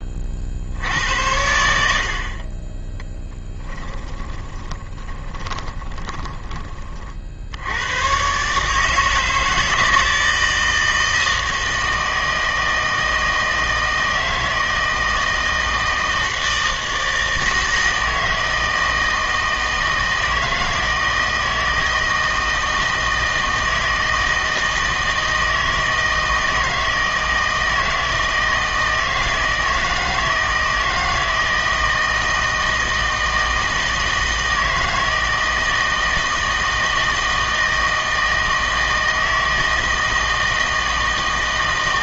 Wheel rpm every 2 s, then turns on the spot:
70, 20, 20, 30, 150, 160, 160, 160, 160, 160, 160, 160, 160, 160, 160, 160, 160, 160, 160, 160, 160.
4-6